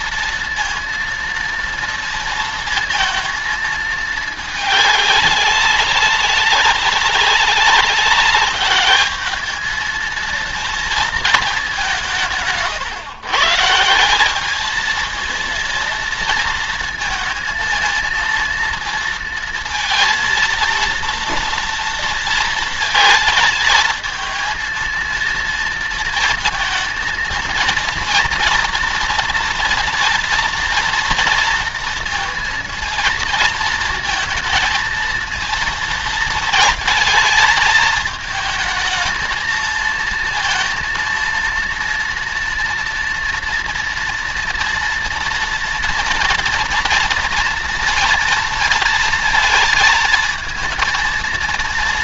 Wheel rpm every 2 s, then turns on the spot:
230, 230, 200, 200, 210, 220, 140, 220, 230, 230, 230, 220, 230, 230, 230, 230, 230, 230, 220, 220, 230, 230, 230, 230, 230, 230.
none